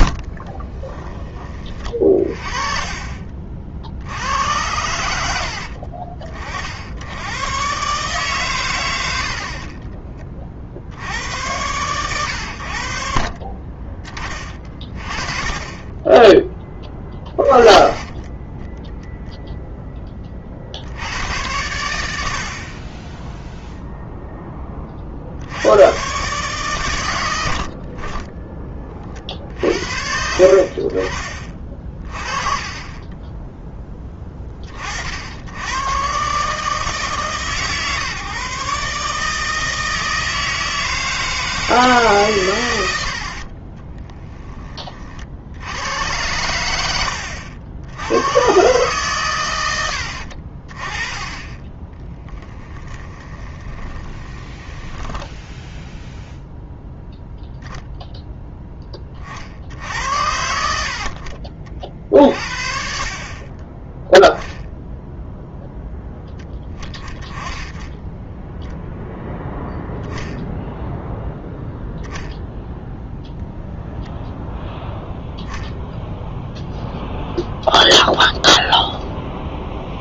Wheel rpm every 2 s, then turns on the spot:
20, 30, 90, 60, 100, 60, 70, 30, 10, 0, 60, 30, 20, 130, 30, 40, 20, 40, 150, 150, 160, 100, 30, 90, 130, 40, 10, 10, 0, 20, 60, 50, 0, 10, 10, 0, 0, 0, 0, 0.
0-2 52-56